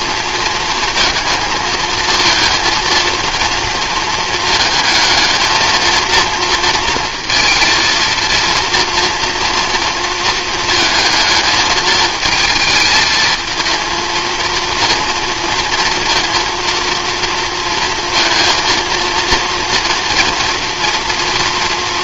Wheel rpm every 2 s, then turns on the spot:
230, 220, 220, 230, 230, 220, 220, 230, 230, 230, 230.
none